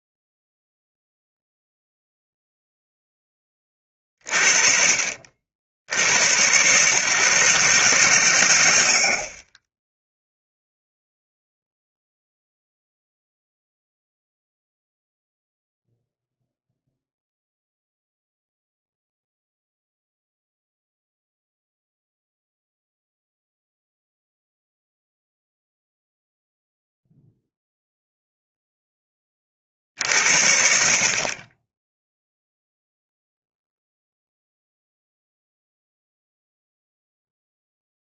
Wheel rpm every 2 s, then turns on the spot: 0, 0, 40, 120, 100, 0, 0, 0, 0, 0, 0, 0, 0, 0, 0, 50, 0, 0, 0.
none